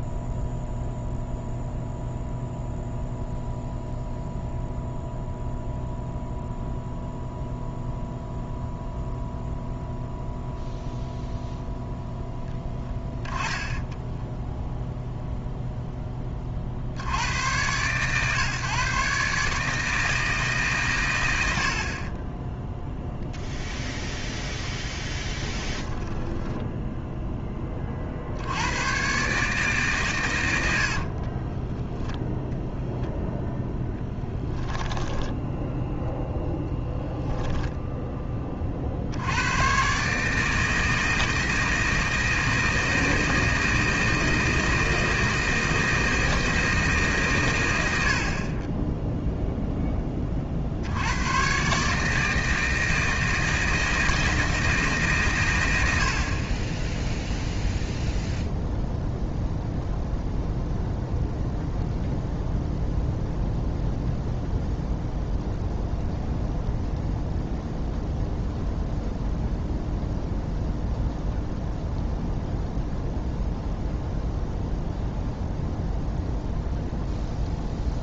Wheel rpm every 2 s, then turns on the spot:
0, 0, 0, 0, 0, 0, 10, 0, 50, 140, 130, 0, 0, 0, 110, 60, 0, 10, 10, 50, 160, 160, 160, 160, 10, 70, 160, 160, 20, 0, 0, 0, 0, 0, 0, 0, 0, 0, 0.
30-32 34-38